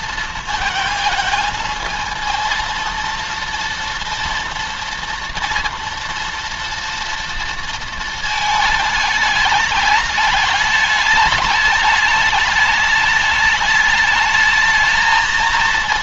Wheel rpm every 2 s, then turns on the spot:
230, 230, 230, 240, 220, 210, 210, 220.
none